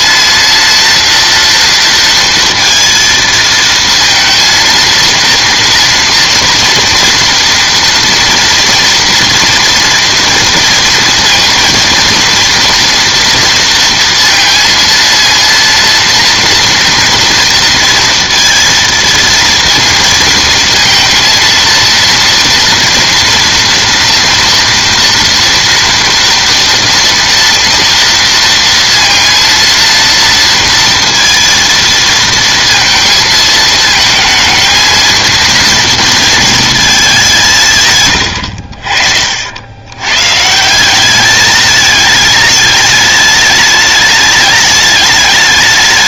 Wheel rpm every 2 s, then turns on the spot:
230, 230, 230, 230, 230, 230, 230, 230, 230, 230, 230, 230, 240, 230, 230, 230, 230, 220, 220, 60, 170, 210, 210.
none